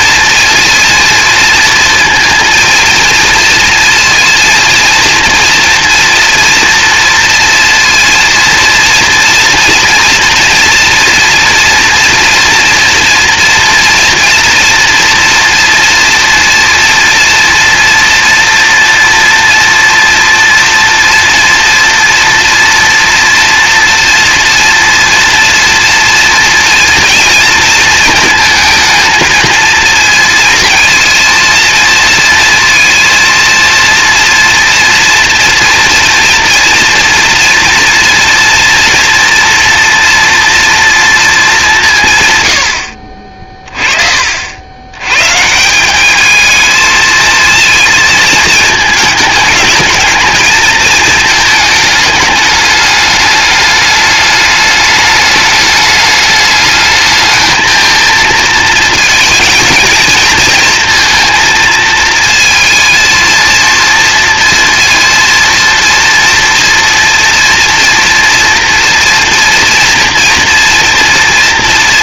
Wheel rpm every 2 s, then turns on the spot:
230, 230, 230, 230, 230, 230, 230, 230, 230, 230, 230, 230, 230, 230, 220, 230, 230, 230, 240, 230, 230, 70, 90, 220, 220, 230, 210, 210, 210, 230, 230, 230, 230, 230, 230, 230.
none